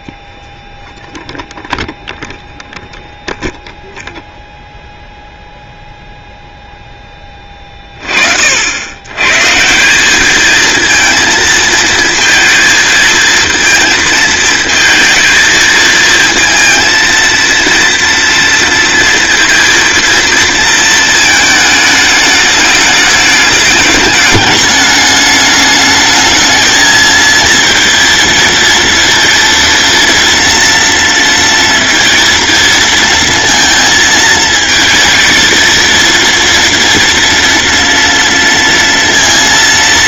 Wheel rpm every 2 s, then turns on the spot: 0, 0, 0, 0, 60, 220, 230, 230, 230, 230, 230, 210, 210, 220, 230, 230, 230, 220, 230, 230.
none